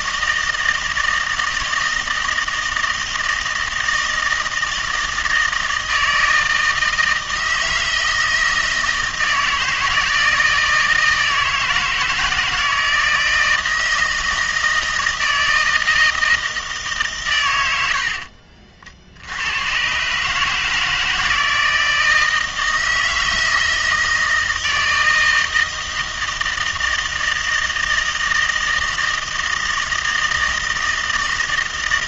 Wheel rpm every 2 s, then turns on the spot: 160, 160, 160, 160, 160, 160, 160, 160, 160, 60, 150, 160, 160, 160, 160, 160.
none